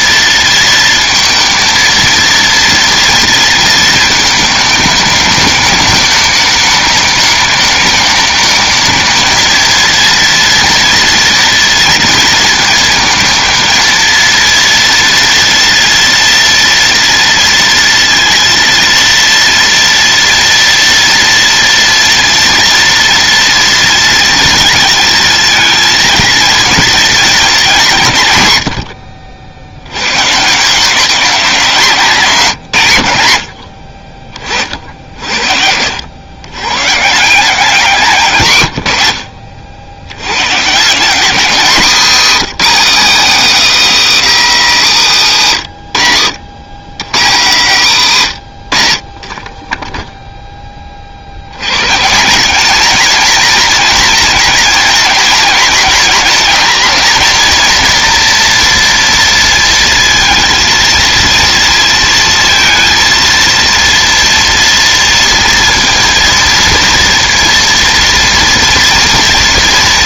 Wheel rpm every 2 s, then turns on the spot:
230, 230, 210, 210, 220, 230, 220, 230, 230, 230, 230, 230, 230, 230, 100, 170, 140, 50, 130, 110, 140, 230, 200, 120, 110, 20, 210, 230, 230, 230, 230, 230, 230, 230, 240.
none